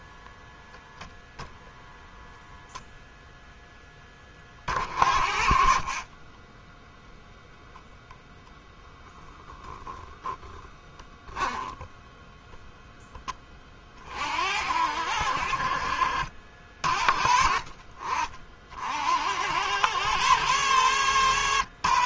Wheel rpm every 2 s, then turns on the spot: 0, 0, 40, 0, 10, 10, 10, 60, 40, 70, 110.
8-10